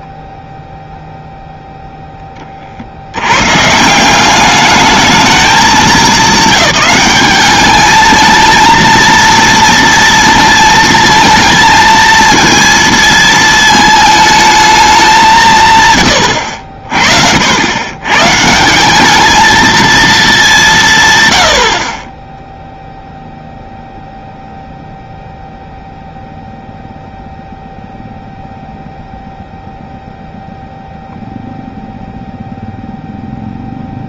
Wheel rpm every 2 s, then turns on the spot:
0, 40, 200, 210, 220, 230, 230, 210, 70, 160, 190, 0, 0, 0, 0, 0, 0.
none